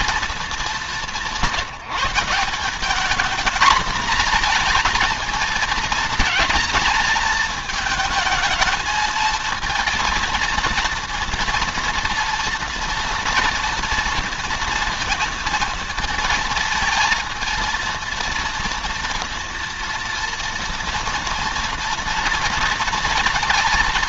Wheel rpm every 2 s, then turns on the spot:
190, 200, 220, 220, 230, 230, 230, 230, 230, 230, 230, 230.
none